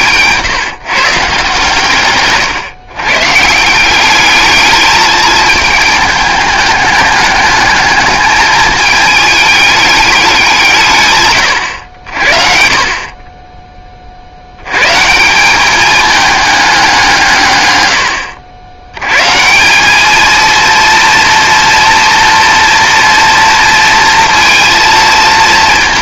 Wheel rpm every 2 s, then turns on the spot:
160, 130, 220, 210, 220, 160, 50, 110, 190, 90, 230, 230, 230.
none